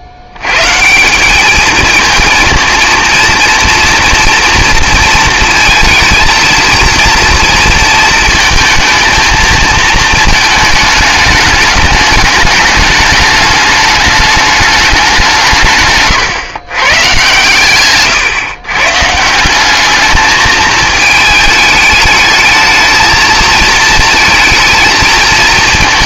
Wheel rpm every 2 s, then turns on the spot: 80, 230, 240, 230, 220, 220, 210, 210, 130, 140, 220, 220, 220.
none